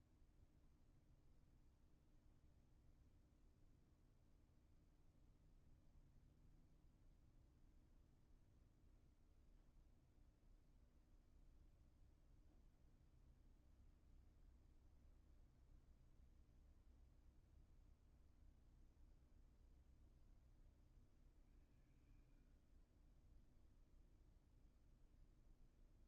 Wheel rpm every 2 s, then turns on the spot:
0, 0, 0, 0, 0, 0, 0, 0, 0, 0, 0, 0, 0.
none